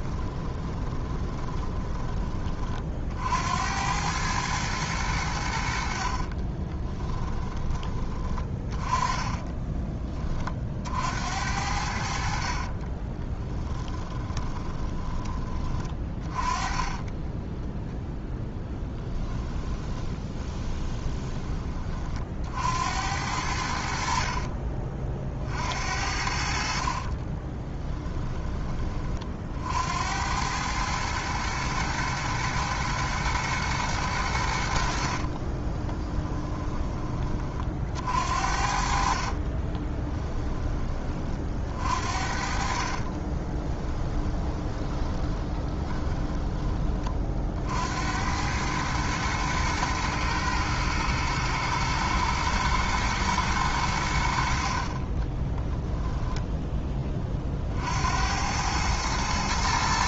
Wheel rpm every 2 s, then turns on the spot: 20, 30, 110, 20, 20, 50, 40, 20, 20, 0, 20, 70, 40, 50, 20, 100, 110, 70, 20, 50, 20, 50, 20, 20, 100, 110, 110, 50, 10, 100.
0-2 6-8 12-16 20-22 26-28 36-38 42-46